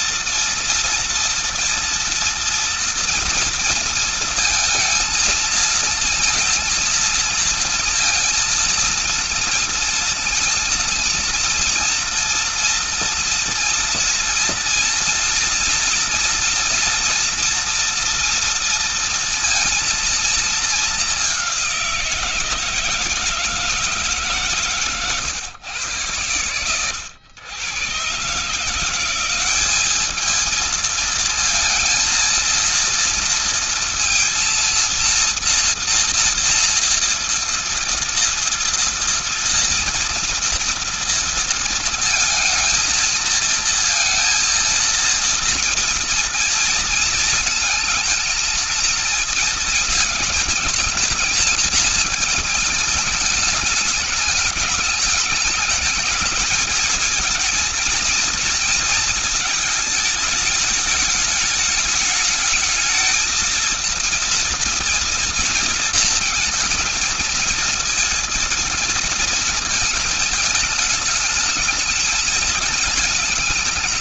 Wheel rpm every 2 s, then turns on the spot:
240, 230, 230, 230, 230, 230, 230, 230, 230, 230, 230, 170, 140, 110, 140, 210, 230, 230, 230, 230, 230, 230, 230, 230, 230, 220, 210, 210, 220, 230, 220, 210, 230, 230, 230, 220, 220.
none